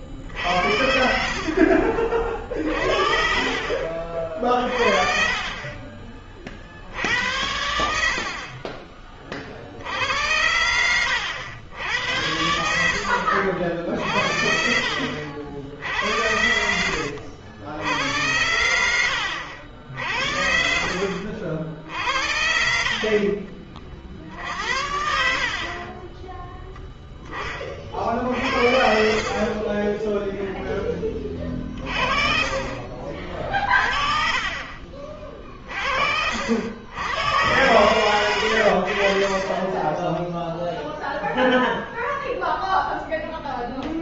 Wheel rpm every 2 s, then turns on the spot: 50, 50, 40, 60, 40, 90, 80, 60, 90, 80, 60, 50, 50, 40, 30, 30, 40, 50, 110, 20, 10, 0.
20-22 32-34 38-42